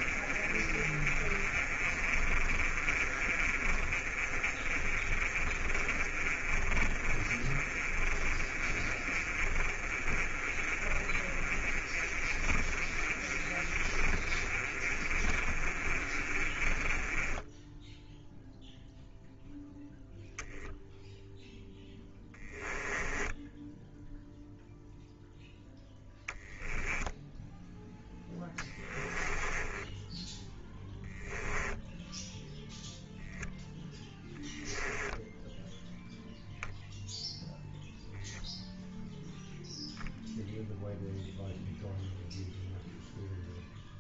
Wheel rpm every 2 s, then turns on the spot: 40, 40, 40, 40, 40, 40, 40, 40, 30, 0, 0, 10, 0, 0, 20, 10, 0, 10, 0, 0, 0, 0.
0-18 22-24 28-32 34-36